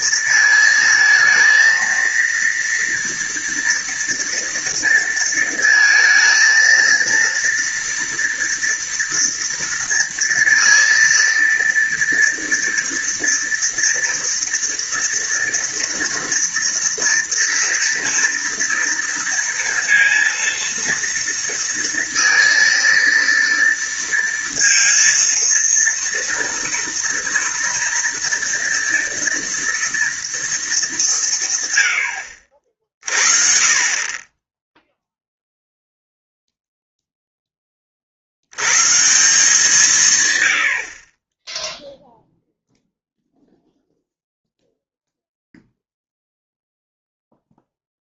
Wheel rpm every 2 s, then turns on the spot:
230, 230, 230, 230, 230, 230, 230, 230, 230, 230, 230, 230, 230, 230, 230, 210, 50, 10, 0, 110, 80, 0, 0, 0.
none